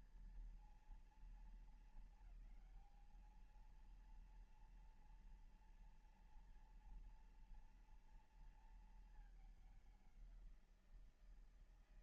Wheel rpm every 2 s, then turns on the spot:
230, 220, 230, 230, 230, 180.
none